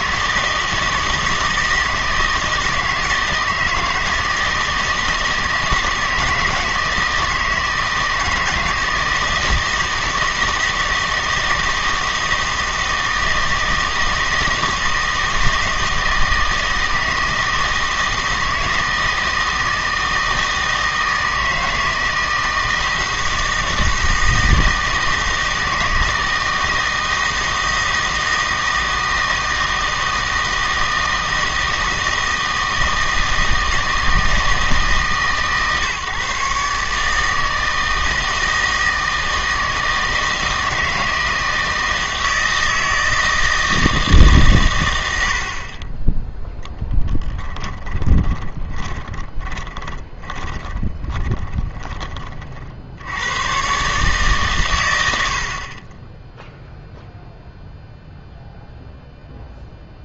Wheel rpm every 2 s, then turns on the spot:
160, 160, 160, 160, 160, 160, 160, 160, 160, 160, 160, 160, 160, 160, 160, 160, 160, 160, 140, 160, 160, 160, 120, 10, 20, 20, 50, 120, 0, 0.
48-52